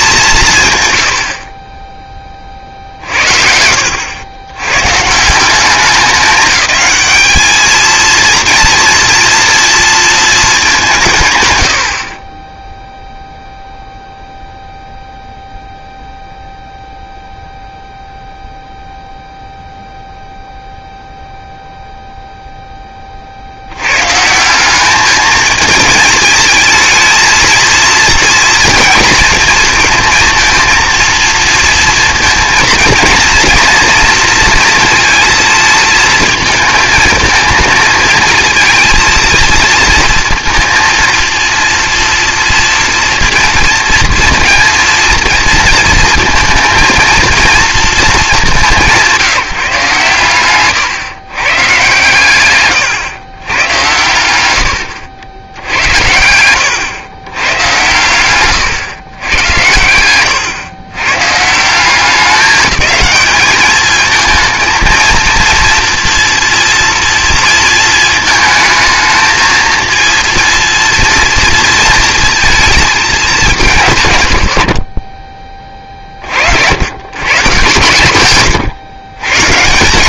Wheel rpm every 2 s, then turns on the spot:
110, 40, 110, 200, 230, 190, 10, 0, 0, 0, 0, 10, 190, 220, 230, 230, 230, 230, 220, 230, 230, 230, 230, 220, 190, 130, 120, 100, 100, 120, 110, 210, 230, 230, 220, 230, 220, 30, 70, 130.
none